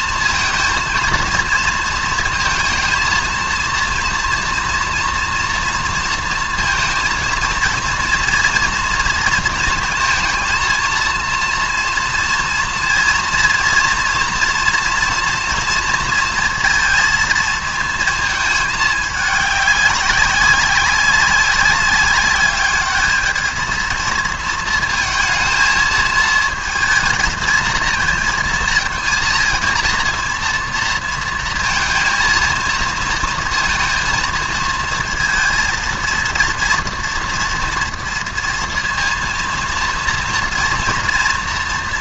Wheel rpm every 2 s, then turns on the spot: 230, 230, 230, 230, 230, 230, 230, 230, 230, 210, 190, 210, 230, 220, 230, 230, 230, 230, 230, 230, 230.
none